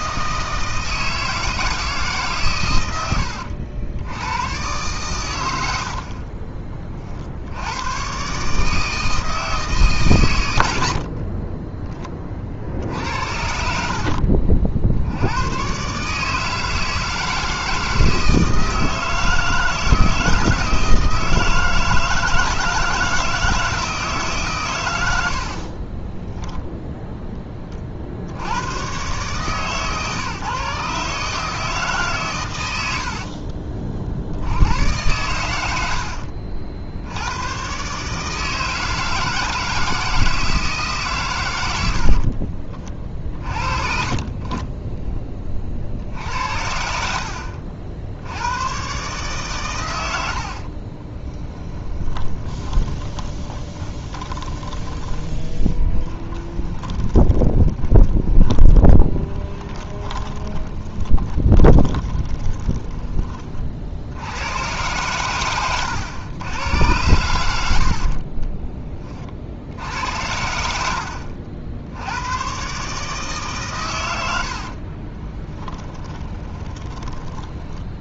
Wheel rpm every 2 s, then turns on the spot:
160, 100, 120, 30, 160, 60, 70, 70, 160, 160, 160, 160, 100, 0, 120, 150, 60, 100, 70, 160, 140, 40, 10, 60, 120, 30, 20, 20, 20, 20, 20, 20, 100, 110, 30, 70, 150, 40, 30.
32-34 50-64 74-76